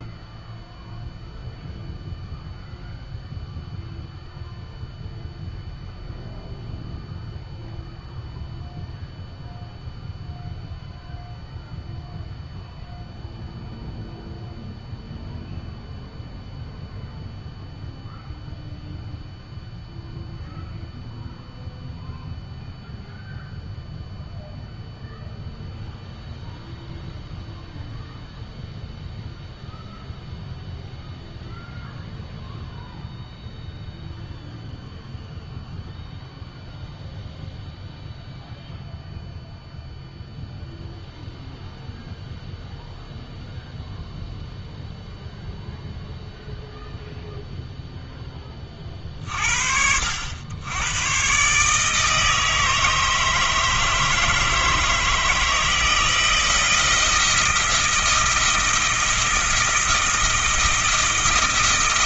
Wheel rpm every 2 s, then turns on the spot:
0, 0, 0, 0, 0, 0, 0, 0, 0, 0, 0, 0, 0, 0, 0, 0, 0, 0, 0, 0, 0, 0, 0, 0, 40, 110, 160, 160, 160, 170, 160.
none